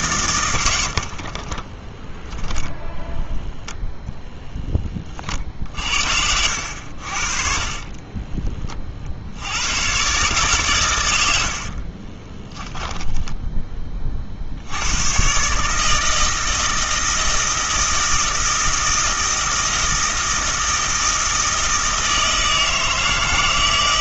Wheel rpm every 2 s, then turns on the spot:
90, 0, 10, 70, 30, 120, 10, 80, 160, 160, 160, 160.
6-8 12-14